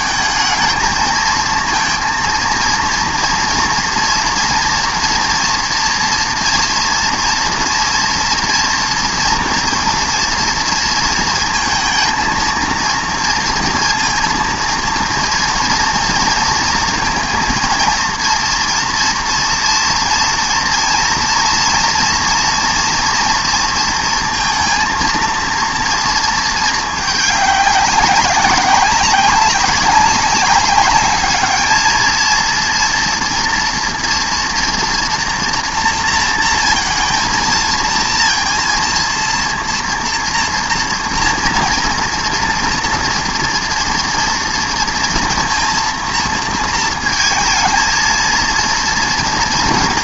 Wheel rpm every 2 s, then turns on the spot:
220, 230, 230, 240, 240, 230, 230, 230, 230, 230, 230, 240, 230, 220, 190, 200, 230, 230, 230, 230, 230, 230, 230, 230, 230.
none